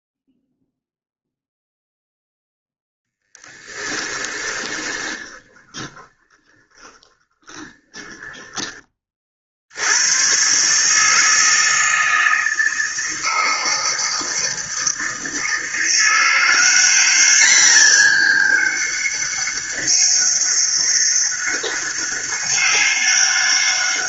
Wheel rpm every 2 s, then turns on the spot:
0, 0, 20, 20, 30, 150, 160, 160, 200, 200, 200, 200.
4-8